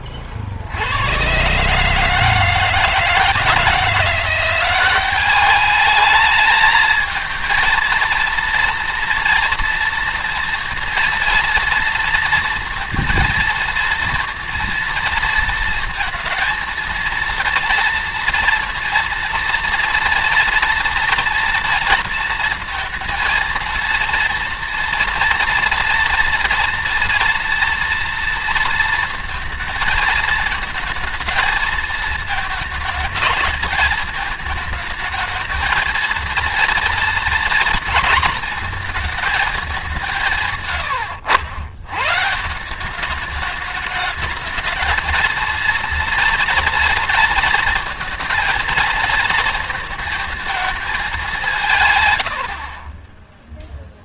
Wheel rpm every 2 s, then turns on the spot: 60, 150, 180, 220, 230, 230, 230, 230, 230, 230, 230, 230, 230, 230, 230, 220, 220, 220, 230, 230, 140, 170, 210, 230, 230, 220, 60.
none